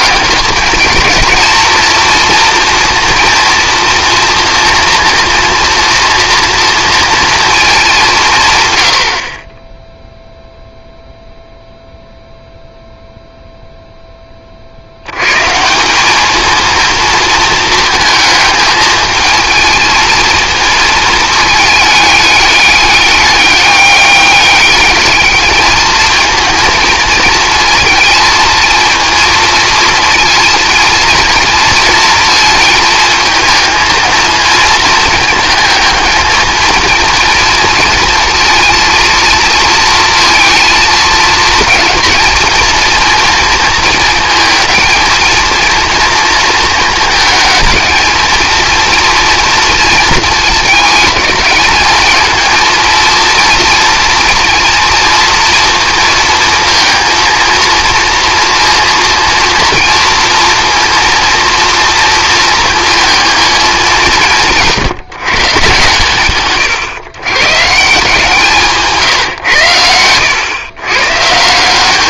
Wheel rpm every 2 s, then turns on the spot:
210, 230, 240, 230, 100, 0, 0, 70, 230, 220, 220, 210, 210, 230, 220, 230, 220, 230, 230, 230, 220, 230, 220, 230, 230, 220, 230, 230, 230, 230, 230, 230, 160, 130, 170, 120.
68-70